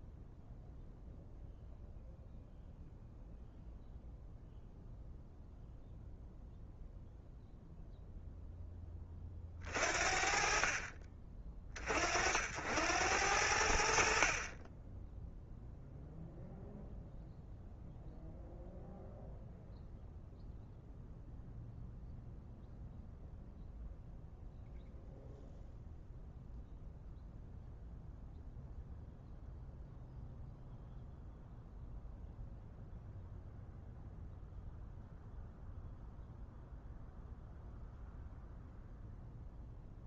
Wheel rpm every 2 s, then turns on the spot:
0, 0, 0, 0, 20, 40, 80, 10, 0, 0, 0, 0, 0, 0, 0, 0, 0, 0, 0, 0.
none